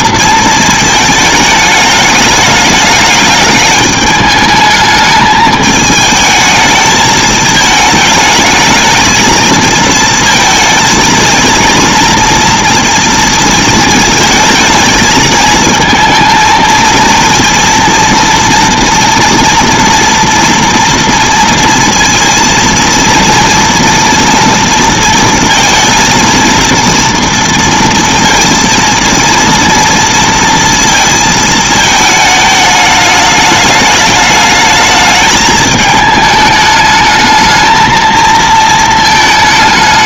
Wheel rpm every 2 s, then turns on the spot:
220, 210, 220, 220, 220, 230, 230, 220, 230, 230, 230, 230, 230, 230, 230, 230, 210, 210, 220, 230.
none